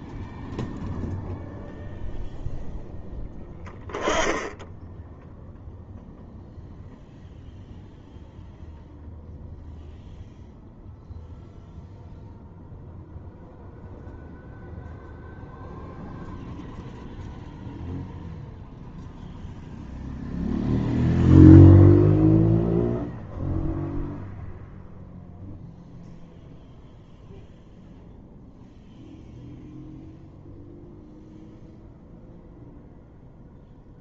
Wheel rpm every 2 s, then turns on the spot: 0, 0, 10, 0, 0, 0, 0, 0, 0, 0, 0, 0, 0, 0, 0, 0, 0.
none